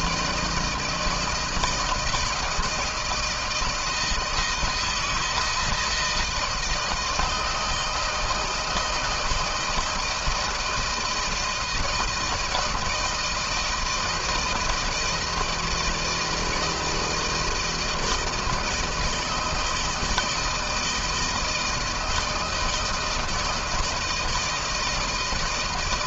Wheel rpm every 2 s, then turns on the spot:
170, 160, 160, 160, 160, 160, 160, 160, 160, 160, 160, 160, 160.
none